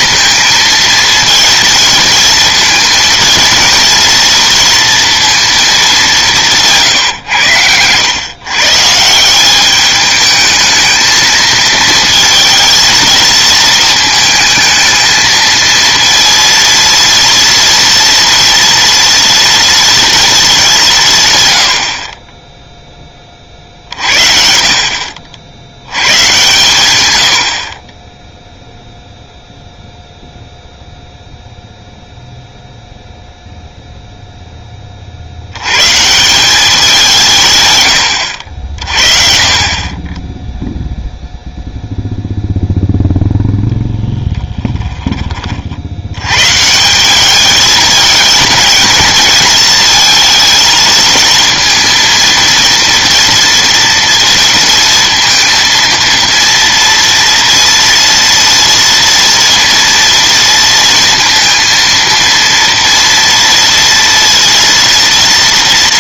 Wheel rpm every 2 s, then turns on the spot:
220, 230, 230, 170, 140, 220, 230, 220, 230, 230, 190, 0, 60, 120, 0, 0, 0, 20, 190, 60, 0, 0, 10, 150, 220, 220, 230, 230, 230, 230, 230, 230, 230.
44-46